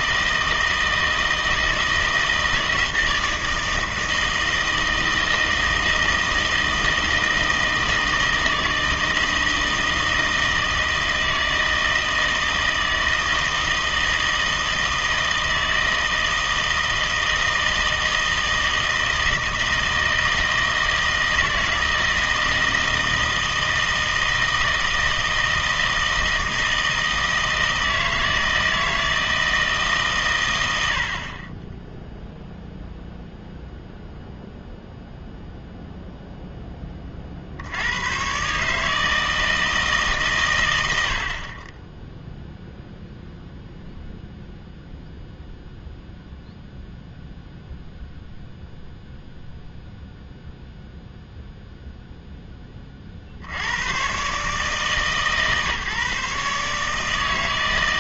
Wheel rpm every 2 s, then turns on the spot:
160, 160, 160, 160, 160, 160, 160, 160, 160, 160, 160, 160, 160, 160, 160, 100, 0, 0, 10, 140, 100, 0, 0, 0, 0, 0, 20, 140, 140.
none